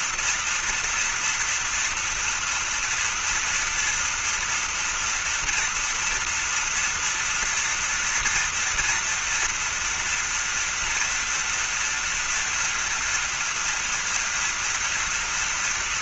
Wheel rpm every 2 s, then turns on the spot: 230, 230, 230, 240, 230, 230, 230, 240.
none